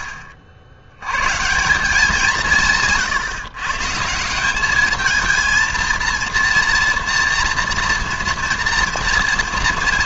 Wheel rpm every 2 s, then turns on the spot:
70, 160, 210, 230, 230.
none